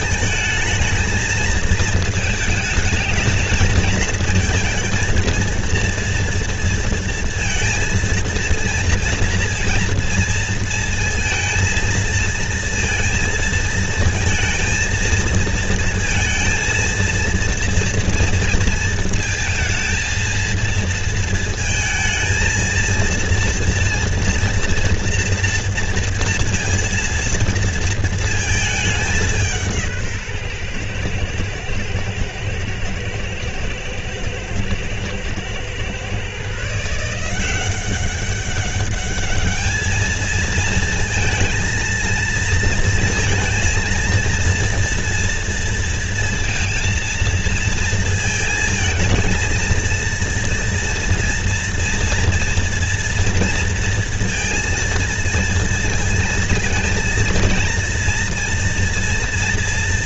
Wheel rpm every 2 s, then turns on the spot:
220, 220, 230, 230, 230, 230, 230, 230, 230, 230, 230, 230, 230, 230, 220, 140, 120, 120, 140, 200, 220, 230, 230, 230, 220, 230, 230, 230, 230, 240.
none